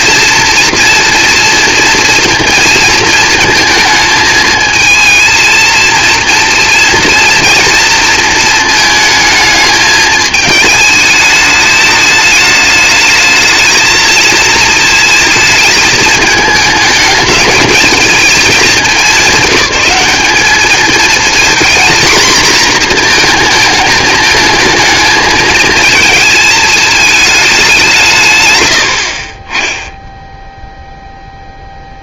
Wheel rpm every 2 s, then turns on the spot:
230, 230, 220, 230, 220, 210, 220, 220, 210, 210, 220, 230, 220, 220, 100, 0.
none